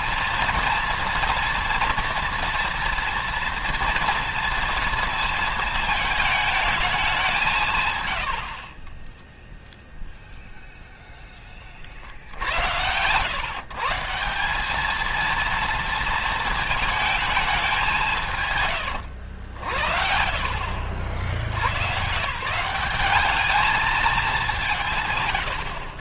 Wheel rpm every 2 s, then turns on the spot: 230, 240, 230, 210, 40, 0, 90, 210, 220, 110, 70, 190, 150.
8-10 18-20